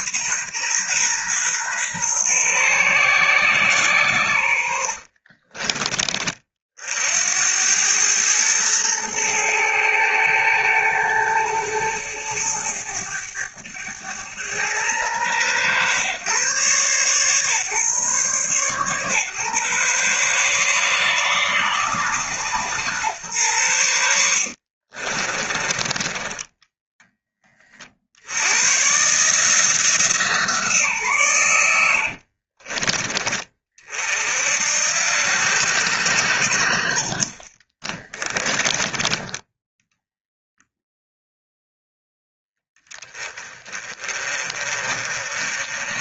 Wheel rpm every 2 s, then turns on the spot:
130, 130, 70, 50, 110, 110, 110, 110, 130, 120, 140, 130, 50, 10, 120, 150, 30, 70, 60, 20, 0, 10, 30.
4-6 24-28 32-34